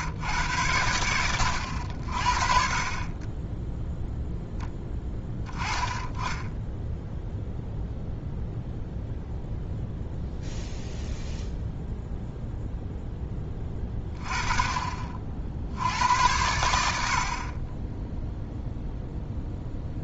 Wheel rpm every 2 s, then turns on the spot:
100, 40, 0, 10, 0, 0, 0, 30, 90, 0.
none